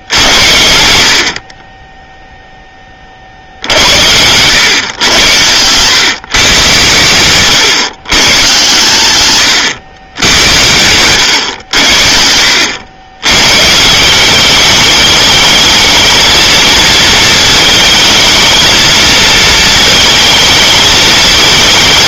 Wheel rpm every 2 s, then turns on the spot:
80, 30, 110, 130, 120, 100, 90, 210, 220, 220, 220.
none